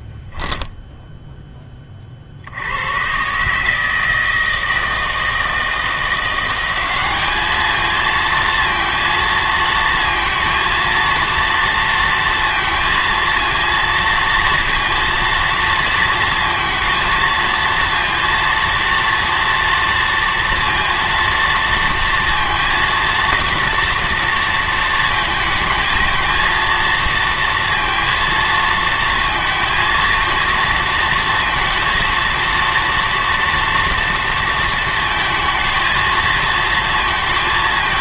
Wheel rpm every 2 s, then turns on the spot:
0, 100, 160, 190, 230, 230, 230, 230, 230, 230, 230, 230, 230, 230, 230, 230, 230, 230, 230.
none